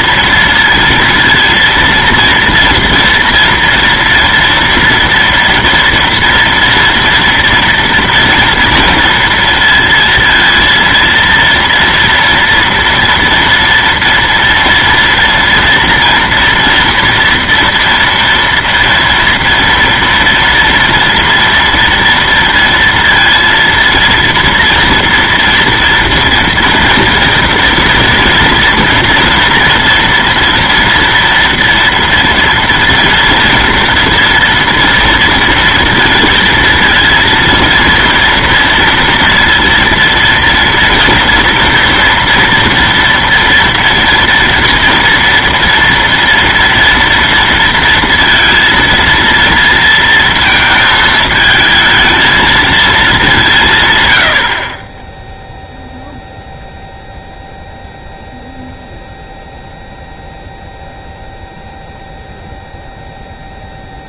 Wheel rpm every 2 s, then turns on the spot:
230, 230, 230, 230, 230, 230, 230, 230, 240, 230, 230, 230, 230, 230, 230, 230, 230, 230, 230, 230, 230, 230, 240, 230, 230, 220, 220, 30, 0, 0, 0, 0.
none